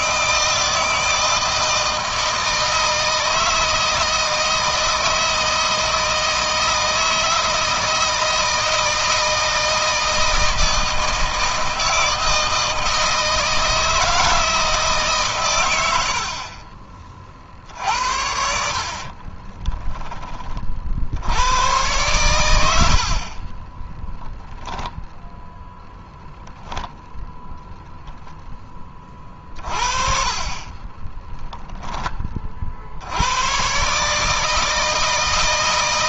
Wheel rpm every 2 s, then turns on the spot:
160, 160, 170, 160, 160, 160, 160, 150, 40, 50, 60, 80, 0, 0, 20, 40, 70, 160.
18-20 30-32